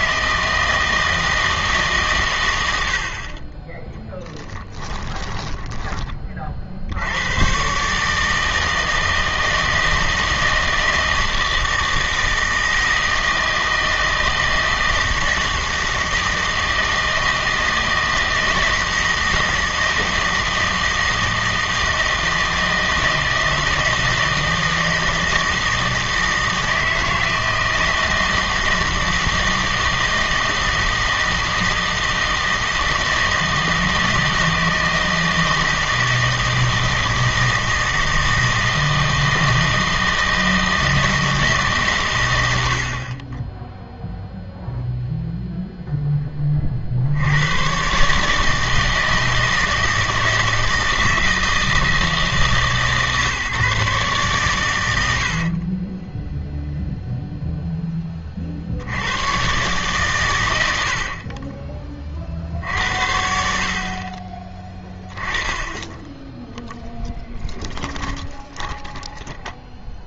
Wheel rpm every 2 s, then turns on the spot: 160, 100, 10, 60, 160, 160, 160, 160, 160, 160, 160, 160, 160, 160, 160, 160, 160, 160, 160, 160, 160, 70, 0, 30, 160, 160, 160, 110, 0, 60, 90, 60, 20, 0, 10.
4-6 68-70